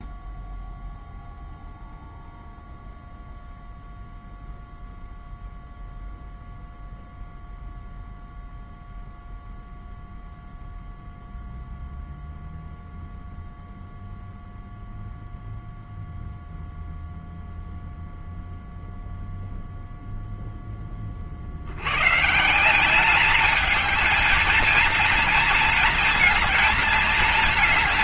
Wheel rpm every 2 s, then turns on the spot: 0, 0, 0, 0, 0, 0, 0, 0, 0, 0, 0, 150, 230, 230.
none